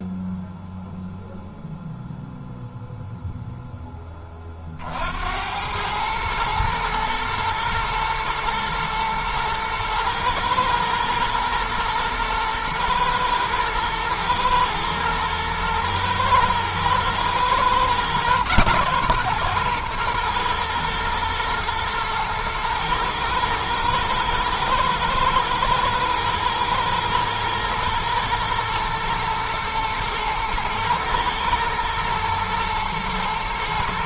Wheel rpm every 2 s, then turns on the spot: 0, 0, 50, 110, 110, 110, 110, 110, 120, 130, 120, 110, 110, 120, 120, 110, 110.
none